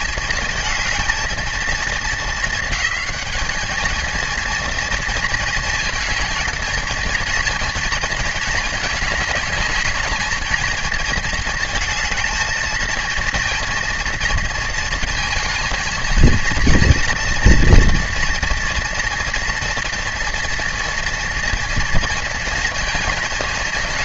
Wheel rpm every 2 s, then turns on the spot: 230, 220, 230, 230, 220, 220, 220, 230, 230, 240, 240, 230.
none